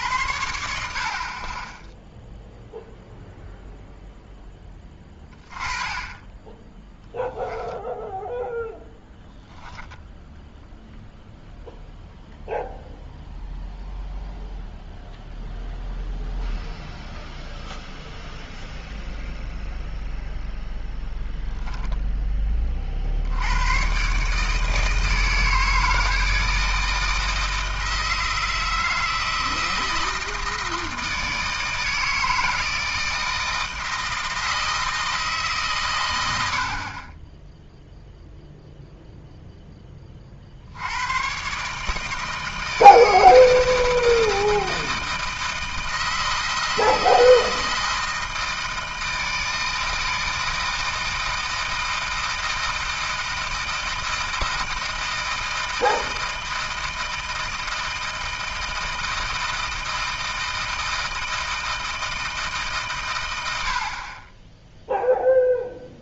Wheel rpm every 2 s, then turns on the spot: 80, 0, 10, 10, 10, 0, 0, 0, 0, 0, 0, 30, 160, 160, 160, 160, 160, 160, 60, 0, 60, 160, 160, 160, 160, 160, 160, 160, 160, 160, 160, 150, 0.
none